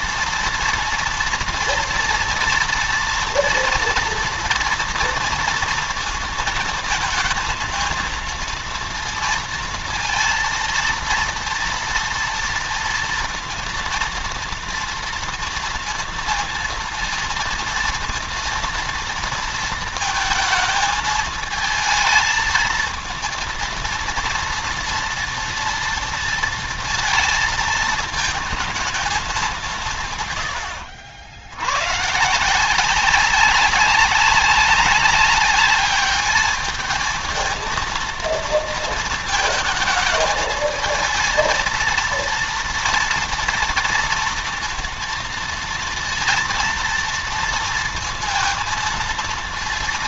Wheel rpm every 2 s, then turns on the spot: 230, 230, 230, 230, 230, 230, 230, 230, 230, 230, 220, 220, 230, 230, 220, 90, 180, 200, 210, 230, 220, 230, 230, 230, 230.
none